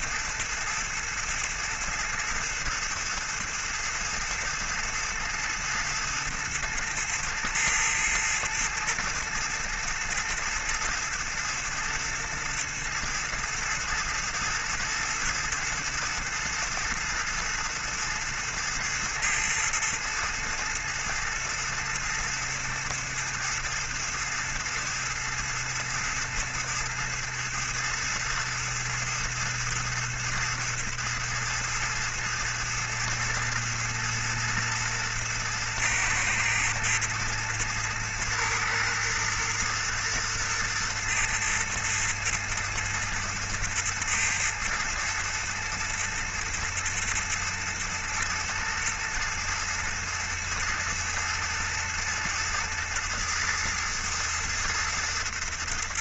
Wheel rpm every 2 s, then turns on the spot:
110, 110, 110, 110, 110, 110, 110, 110, 110, 110, 110, 110, 110, 110, 110, 110, 110, 120, 110, 110, 110, 110, 110, 110, 110, 110, 110, 110.
none